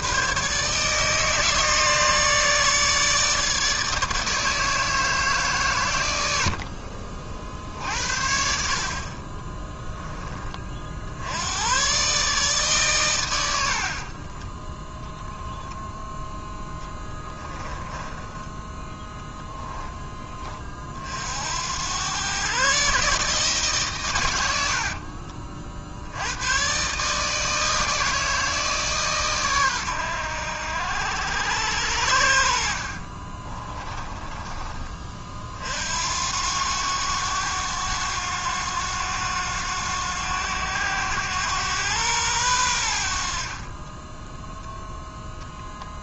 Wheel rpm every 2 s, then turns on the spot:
150, 150, 150, 50, 40, 50, 120, 0, 20, 10, 40, 140, 70, 140, 150, 90, 50, 30, 90, 90, 100, 80, 0.
16-18 24-26 32-34